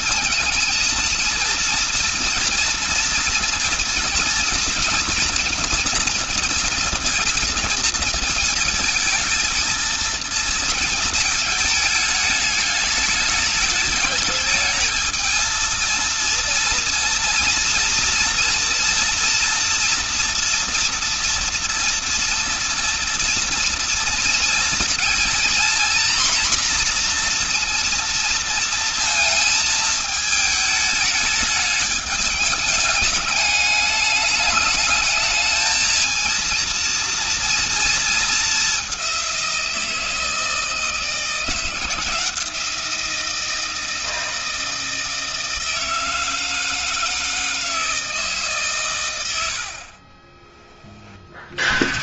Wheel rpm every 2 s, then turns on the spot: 230, 230, 230, 230, 230, 220, 210, 220, 230, 230, 230, 240, 240, 240, 230, 210, 210, 210, 230, 200, 160, 170, 160, 160, 130, 40.
none